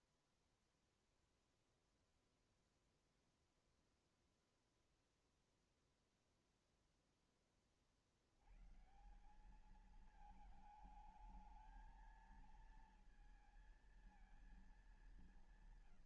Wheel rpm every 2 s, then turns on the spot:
0, 0, 0, 0, 60, 210, 220, 220.
none